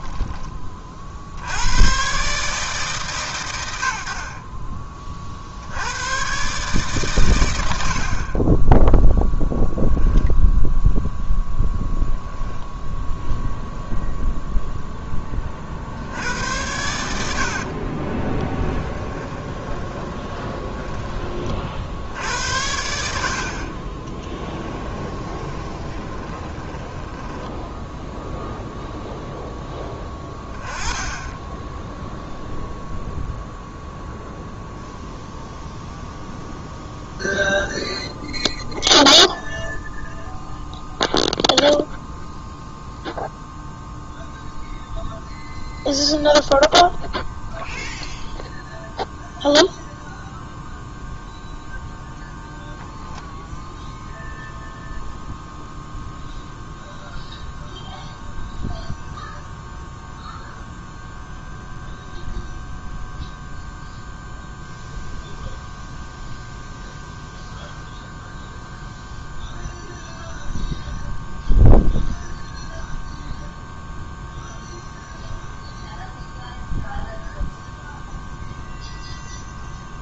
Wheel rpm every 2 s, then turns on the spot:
40, 140, 30, 130, 20, 0, 0, 10, 80, 20, 20, 80, 20, 10, 0, 20, 0, 0, 0, 0, 0, 0, 0, 0, 0, 0, 10, 0, 0, 0, 0, 0, 0, 0, 0, 0, 0, 0, 0, 0.
8-10 18-20 24-28